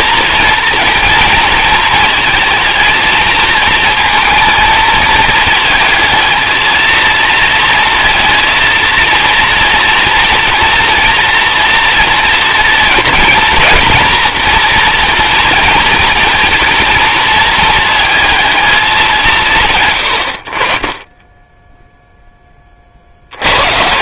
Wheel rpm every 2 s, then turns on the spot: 230, 230, 220, 230, 230, 230, 230, 230, 230, 200, 40, 30.
none